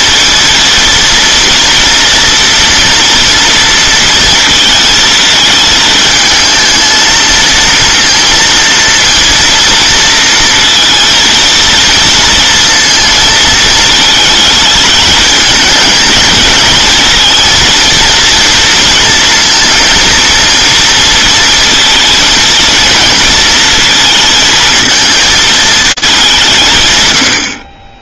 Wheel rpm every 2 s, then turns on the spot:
230, 230, 230, 220, 230, 230, 230, 220, 220, 230, 230, 220, 220, 160.
none